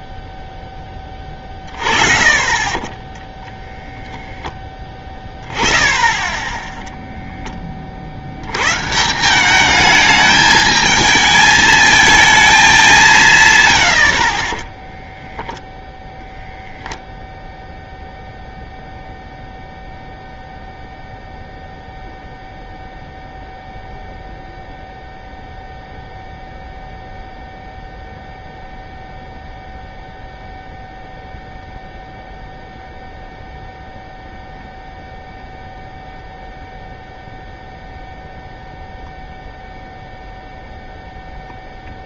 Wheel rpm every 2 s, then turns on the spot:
10, 30, 10, 10, 90, 220, 210, 30, 10, 0, 0, 0, 0, 0, 0, 0, 0, 0, 0, 0, 0.
none